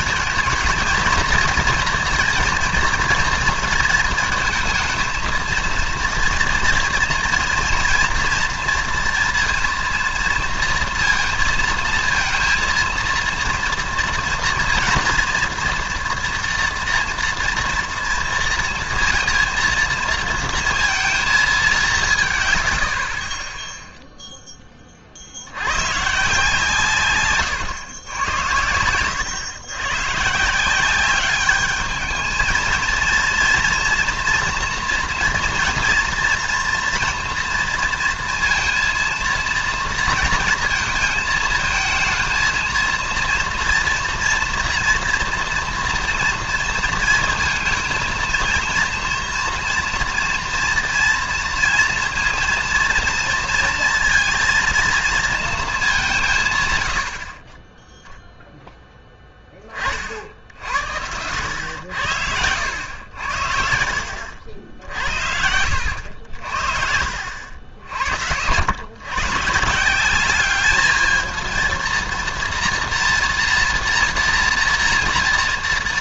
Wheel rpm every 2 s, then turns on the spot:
230, 230, 230, 240, 230, 230, 230, 230, 230, 230, 230, 130, 10, 140, 100, 170, 220, 240, 240, 230, 230, 230, 240, 230, 230, 230, 230, 230, 120, 0, 60, 90, 70, 60, 100, 210, 230, 230.
none